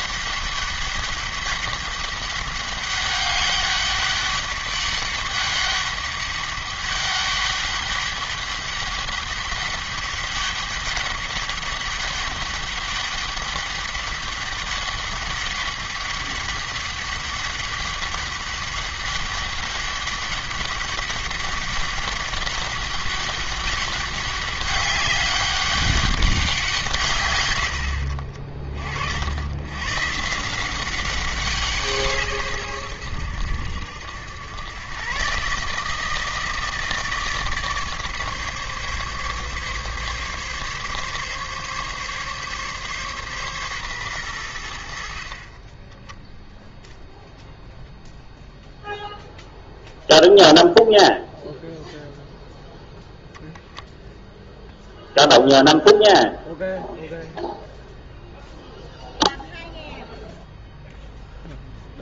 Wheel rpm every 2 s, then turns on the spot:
200, 200, 200, 200, 200, 200, 200, 200, 200, 200, 200, 200, 200, 140, 50, 180, 120, 110, 160, 140, 140, 140, 80, 10, 0, 0, 0, 0, 0, 0, 0.
none